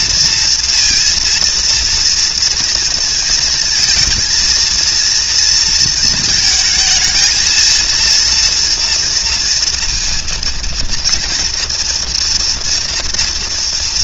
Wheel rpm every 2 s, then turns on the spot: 230, 230, 230, 220, 230, 230, 230.
none